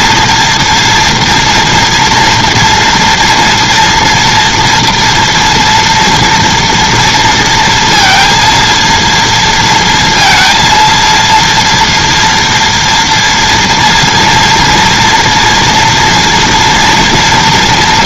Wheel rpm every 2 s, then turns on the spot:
240, 240, 240, 230, 230, 230, 230, 230, 230.
none